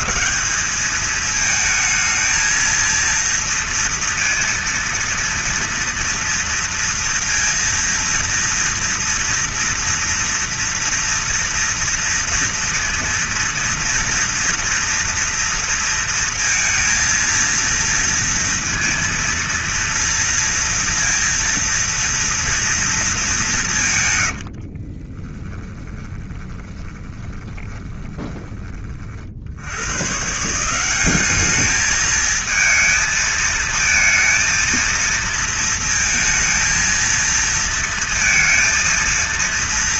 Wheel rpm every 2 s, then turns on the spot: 200, 230, 230, 230, 230, 230, 230, 230, 230, 230, 230, 220, 50, 20, 30, 180, 220, 230, 230, 230.
24-28